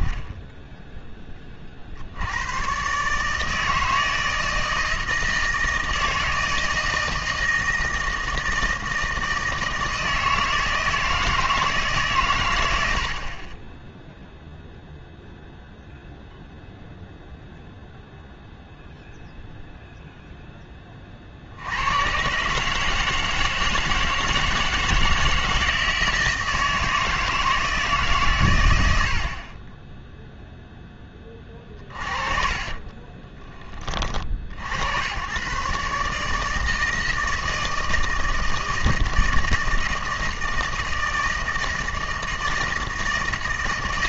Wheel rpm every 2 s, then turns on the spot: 10, 90, 160, 160, 160, 160, 130, 0, 0, 0, 40, 160, 160, 160, 80, 20, 20, 100, 160, 160, 160, 160.
32-34